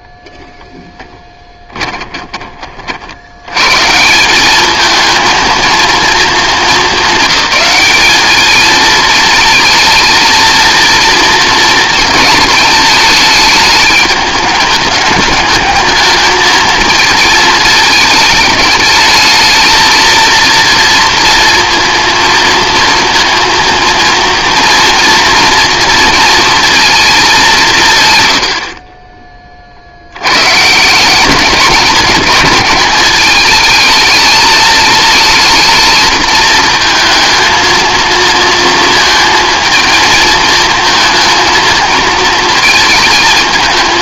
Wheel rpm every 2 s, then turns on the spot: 0, 30, 210, 220, 220, 230, 220, 210, 220, 220, 230, 230, 230, 230, 50, 150, 220, 220, 220, 230, 220, 220.
none